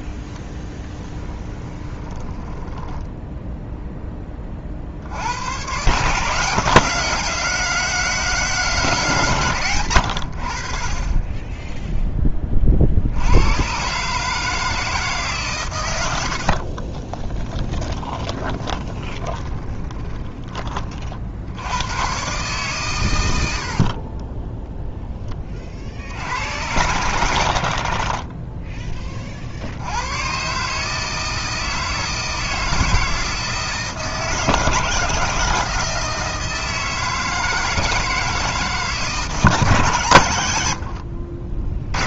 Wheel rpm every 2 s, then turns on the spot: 10, 10, 50, 180, 170, 40, 50, 160, 40, 20, 30, 130, 0, 80, 10, 150, 160, 150, 160, 150, 90.
0-4 16-20 40-42